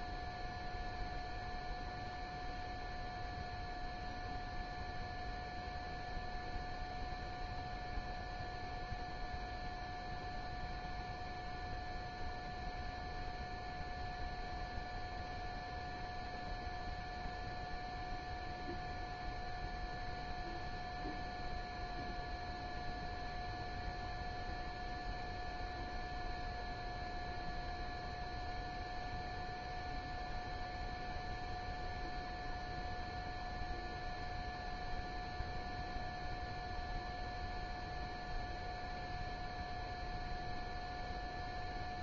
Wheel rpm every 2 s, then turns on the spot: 0, 0, 0, 0, 0, 0, 0, 0, 0, 0, 0, 0, 0, 0, 0, 0, 0, 0, 0, 0, 0.
none